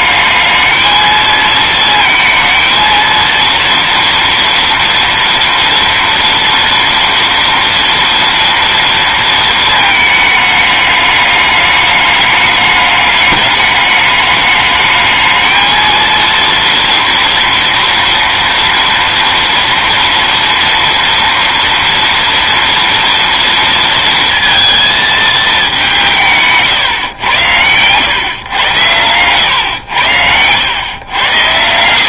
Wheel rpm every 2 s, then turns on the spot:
220, 220, 230, 230, 230, 210, 210, 210, 230, 230, 230, 230, 230, 140, 110, 110.
30-32